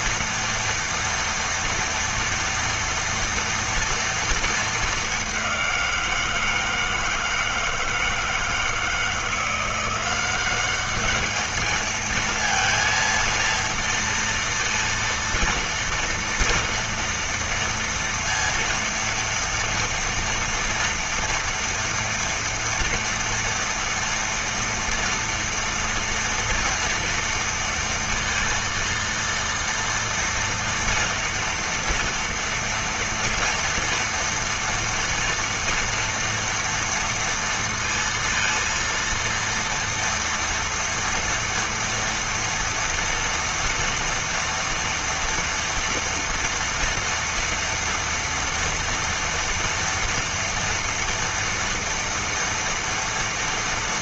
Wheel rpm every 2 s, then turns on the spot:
230, 230, 210, 160, 170, 210, 230, 230, 230, 230, 230, 230, 230, 230, 230, 230, 230, 230, 230, 230, 230, 230, 230, 240, 230, 230, 230.
none